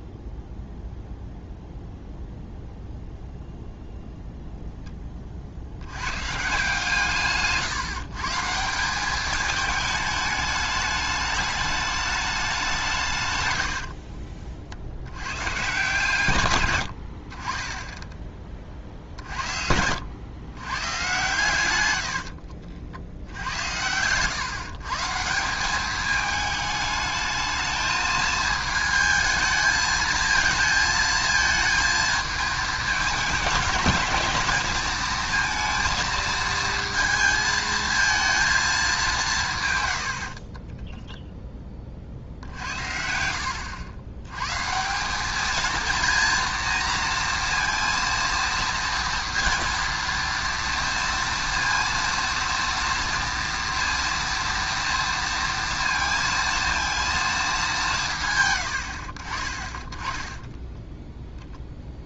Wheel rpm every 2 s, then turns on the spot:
0, 0, 0, 150, 170, 210, 190, 50, 100, 30, 110, 70, 130, 210, 220, 220, 210, 220, 230, 220, 30, 60, 140, 230, 230, 230, 230, 230, 230, 110, 10.
22-24 40-42